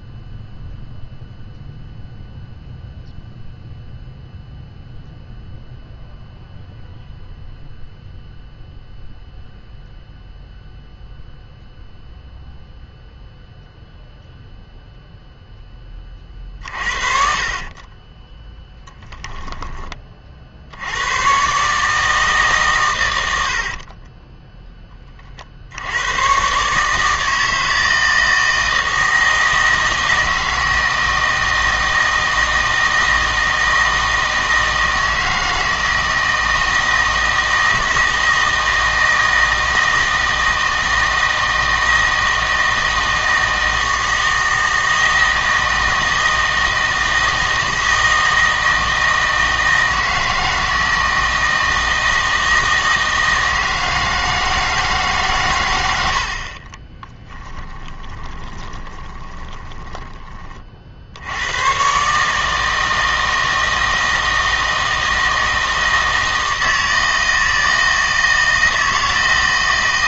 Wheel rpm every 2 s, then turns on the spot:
0, 0, 0, 0, 0, 0, 0, 0, 40, 10, 70, 130, 10, 140, 160, 160, 160, 160, 160, 160, 160, 160, 160, 160, 160, 160, 160, 160, 40, 20, 40, 160, 160, 160, 160.
16-20 56-60